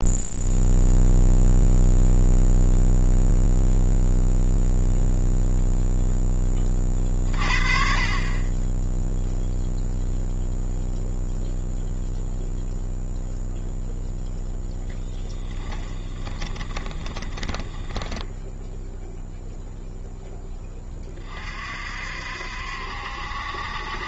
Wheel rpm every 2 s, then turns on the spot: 0, 0, 0, 30, 10, 0, 0, 0, 20, 0, 20, 70.
16-18